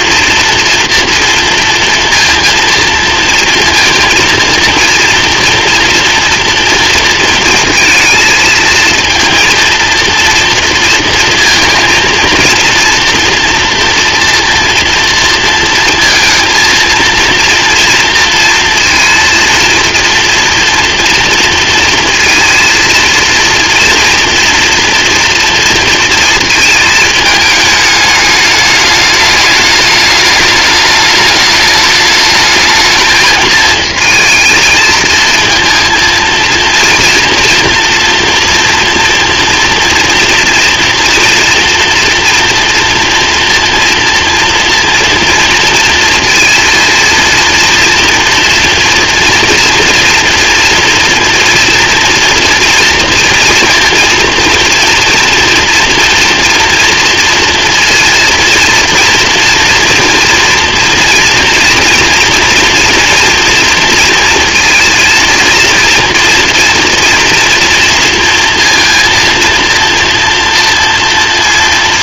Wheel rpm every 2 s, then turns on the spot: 240, 230, 230, 230, 220, 230, 230, 230, 230, 230, 230, 230, 230, 220, 210, 210, 220, 220, 230, 230, 230, 230, 230, 230, 240, 230, 230, 240, 230, 230, 230, 230, 230, 240, 230, 230.
none